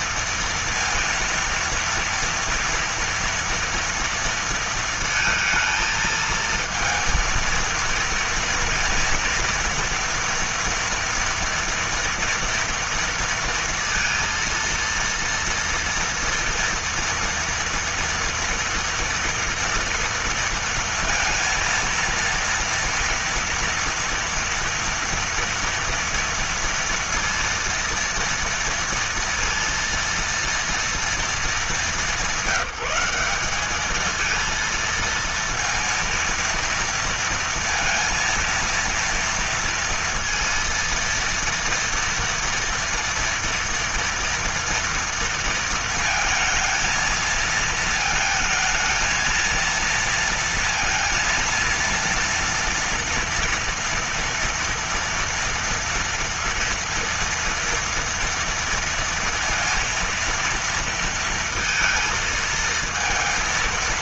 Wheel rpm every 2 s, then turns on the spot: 230, 230, 230, 230, 230, 230, 230, 230, 230, 230, 230, 230, 230, 230, 230, 230, 190, 230, 230, 230, 230, 230, 240, 220, 220, 230, 230, 230, 240, 230, 230, 230.
none